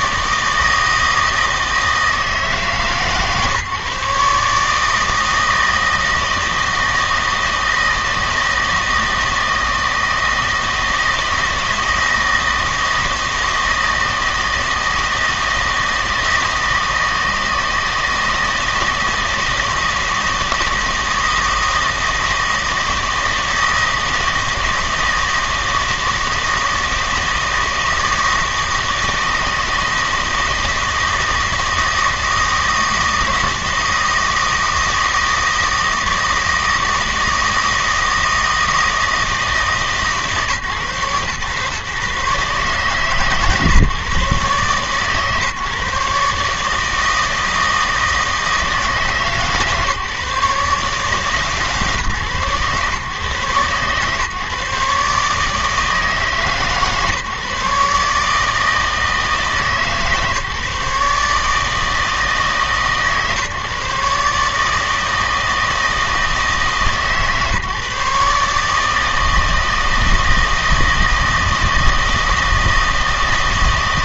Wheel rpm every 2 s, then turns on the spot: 160, 160, 150, 160, 160, 160, 160, 160, 160, 160, 160, 160, 160, 160, 160, 160, 160, 160, 160, 160, 140, 140, 140, 150, 160, 150, 130, 140, 150, 160, 150, 150, 150, 160, 150, 160, 160.
none